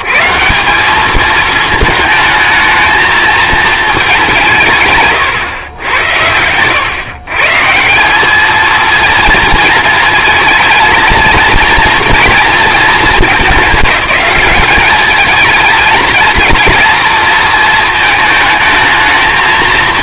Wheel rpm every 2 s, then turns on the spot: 140, 220, 160, 110, 220, 220, 230, 220, 230, 220.
none